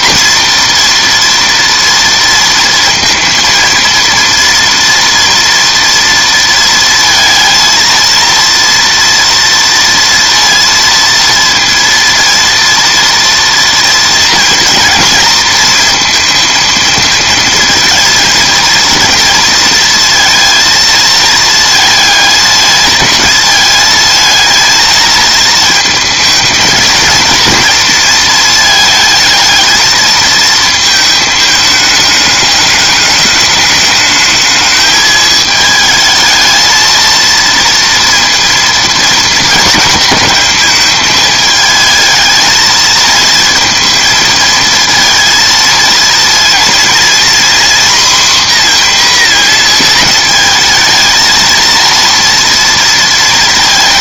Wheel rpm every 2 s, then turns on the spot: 240, 230, 230, 230, 230, 230, 230, 230, 230, 230, 230, 220, 220, 220, 220, 220, 210, 220, 220, 230, 220, 220, 220, 230, 250, 220, 230.
none